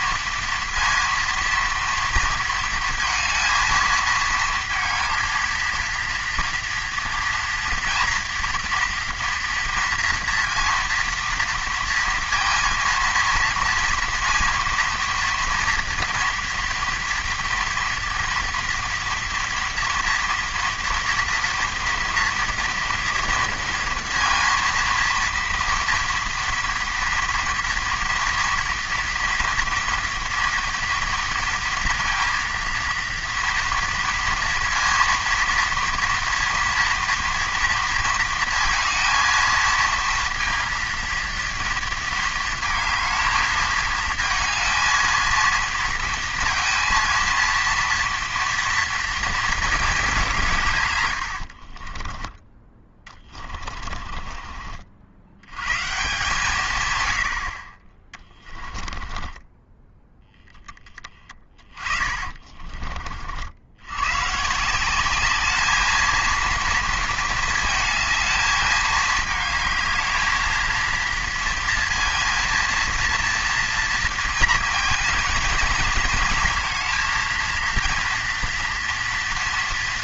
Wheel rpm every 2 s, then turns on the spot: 230, 230, 230, 230, 230, 230, 230, 230, 230, 230, 230, 240, 230, 230, 230, 230, 230, 230, 230, 230, 230, 220, 230, 230, 230, 150, 20, 40, 140, 20, 10, 30, 160, 230, 220, 230, 230, 230, 230, 230.
58-60